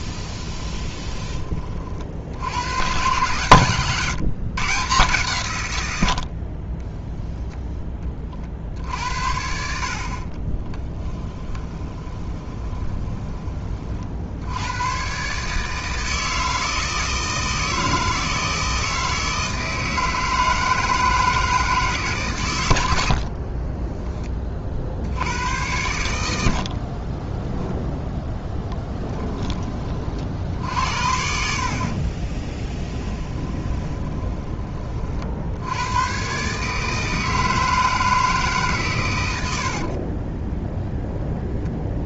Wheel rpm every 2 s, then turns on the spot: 20, 120, 140, 10, 70, 20, 20, 110, 160, 160, 160, 90, 60, 40, 10, 60, 10, 30, 150, 130, 0.
0-2 10-14 26-28 32-34